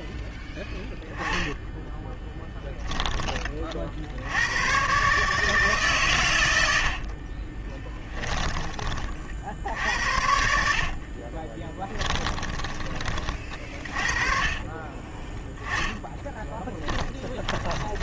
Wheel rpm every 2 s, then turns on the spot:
0, 10, 130, 60, 50, 40, 20, 20, 10.
6-8 10-12 16-18